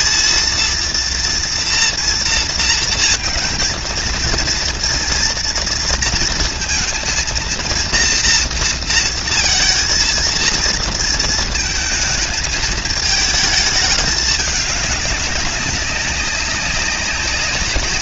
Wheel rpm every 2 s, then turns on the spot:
230, 220, 230, 230, 230, 230, 220, 200, 190.
none